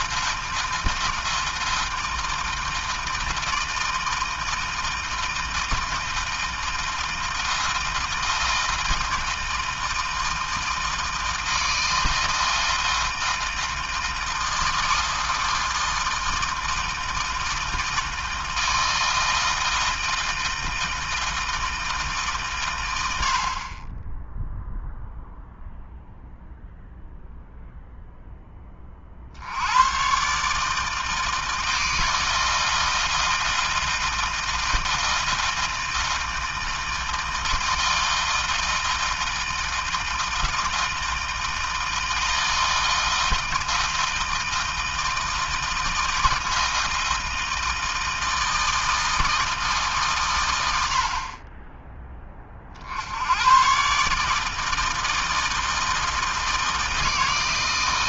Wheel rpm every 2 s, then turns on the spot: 160, 160, 160, 160, 160, 160, 160, 160, 160, 160, 160, 80, 0, 0, 50, 160, 160, 160, 160, 160, 160, 160, 160, 160, 160, 60, 80, 160, 160.
none